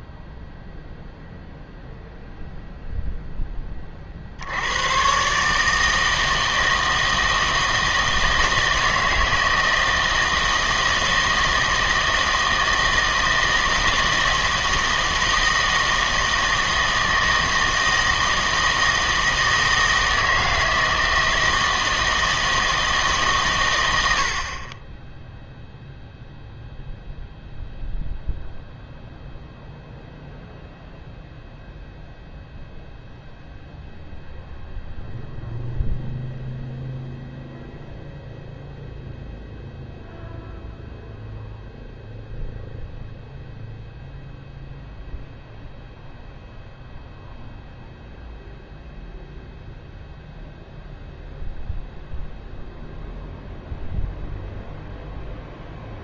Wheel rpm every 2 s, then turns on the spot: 0, 0, 90, 160, 160, 160, 160, 160, 160, 160, 160, 160, 30, 0, 0, 0, 0, 0, 0, 0, 0, 0, 0, 0, 0, 0, 0, 0.
none